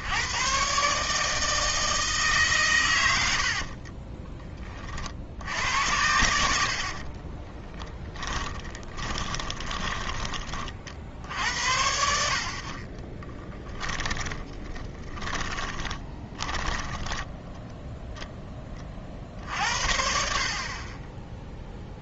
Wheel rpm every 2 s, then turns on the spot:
140, 110, 40, 60, 20, 40, 40, 10, 20, 30, 30.
6-10 14-18